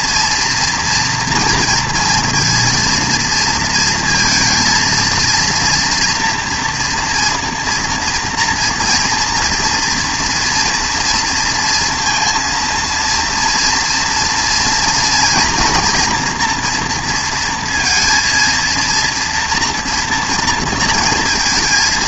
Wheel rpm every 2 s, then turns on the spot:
230, 230, 230, 240, 240, 240, 230, 230, 240, 230, 230.
none